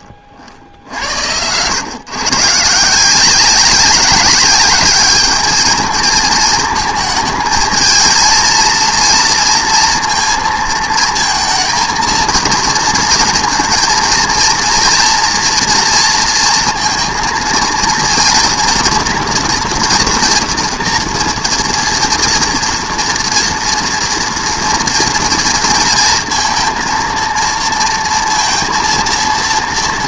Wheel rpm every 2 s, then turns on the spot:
70, 140, 200, 220, 230, 230, 230, 230, 230, 230, 230, 230, 230, 230, 230.
none